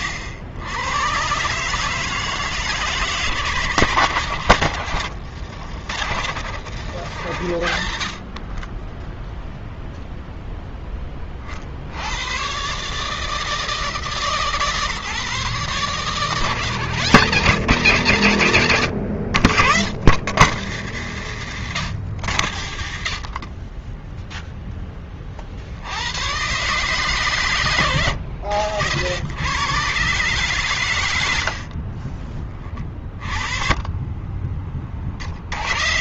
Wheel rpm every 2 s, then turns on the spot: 90, 160, 120, 120, 30, 10, 120, 150, 130, 90, 130, 90, 10, 130, 70, 130, 30, 20.
none